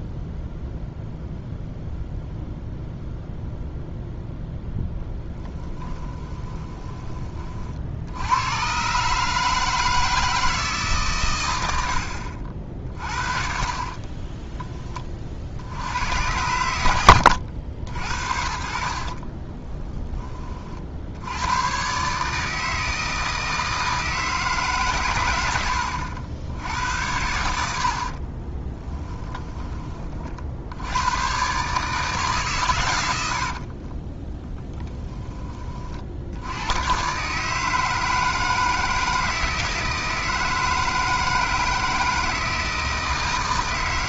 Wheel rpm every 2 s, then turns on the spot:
0, 0, 10, 20, 130, 150, 50, 30, 90, 40, 60, 160, 140, 80, 10, 80, 110, 10, 110, 160, 160, 160.
28-30